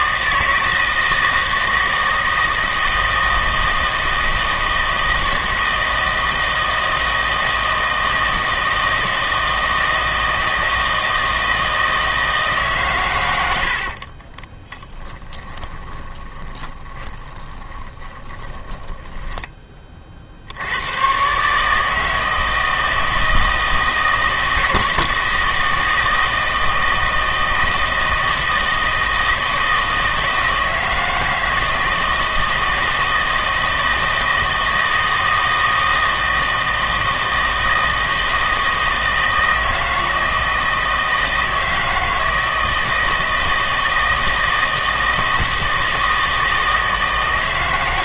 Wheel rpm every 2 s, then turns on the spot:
160, 160, 160, 160, 160, 160, 130, 20, 20, 10, 100, 160, 160, 160, 160, 160, 160, 160, 160, 160, 160, 160, 160, 160.
14-20